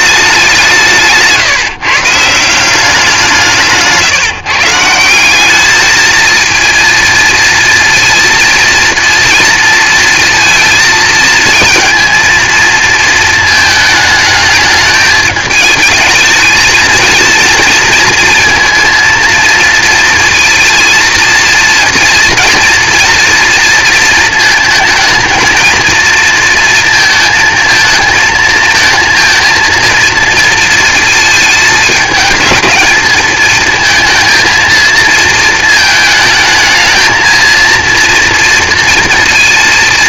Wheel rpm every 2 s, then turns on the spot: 170, 180, 160, 230, 230, 230, 230, 210, 220, 230, 230, 240, 220, 230, 220, 230, 210, 230, 220, 230.
none